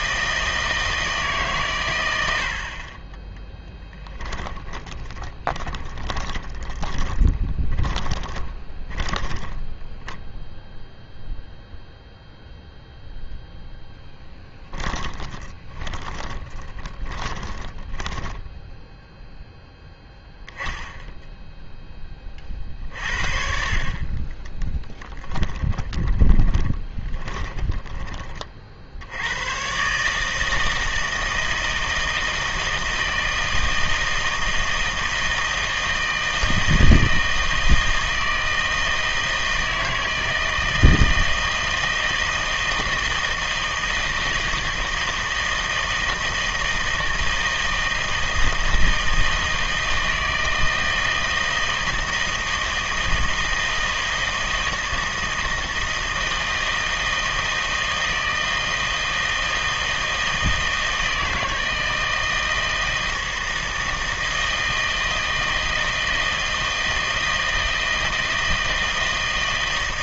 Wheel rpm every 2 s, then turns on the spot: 160, 50, 20, 20, 30, 0, 0, 10, 10, 10, 10, 50, 10, 20, 50, 160, 160, 160, 160, 160, 160, 160, 160, 160, 160, 160, 160, 160, 160, 160, 160, 160, 160, 160, 160.
4-10 14-20 24-28